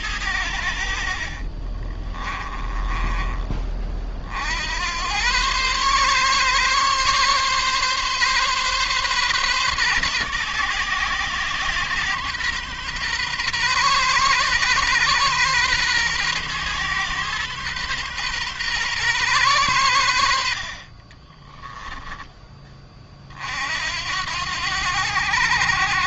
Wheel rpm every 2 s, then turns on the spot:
80, 20, 80, 130, 130, 130, 120, 120, 130, 120, 50, 20, 90.
0-4